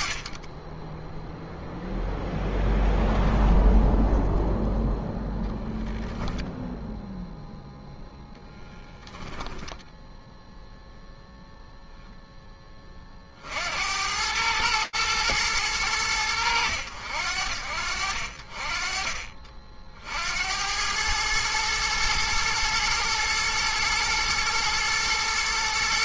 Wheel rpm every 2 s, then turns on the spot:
0, 0, 0, 0, 0, 10, 100, 90, 60, 90, 110, 110, 110.
none